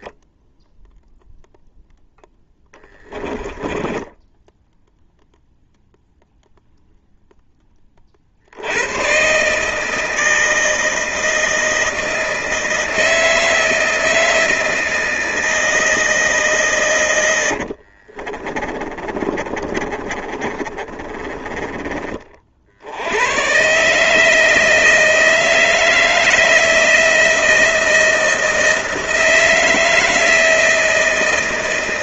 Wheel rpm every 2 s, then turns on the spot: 0, 10, 0, 0, 120, 160, 160, 160, 100, 30, 30, 100, 160, 170, 160, 160.
2-4 16-22